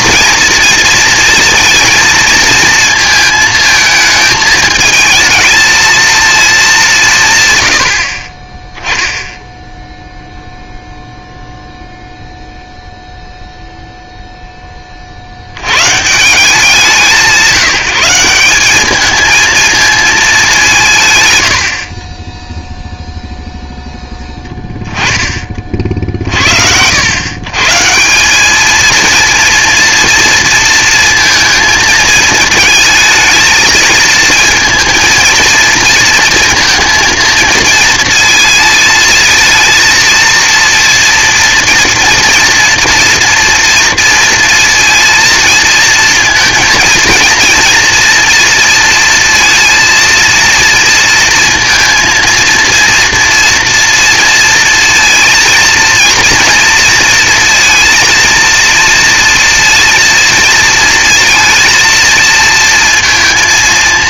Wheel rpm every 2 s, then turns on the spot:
230, 220, 220, 220, 10, 0, 0, 10, 170, 190, 190, 0, 10, 80, 220, 230, 220, 230, 230, 230, 230, 230, 230, 230, 230, 230, 230, 230, 230, 230, 230, 230.
none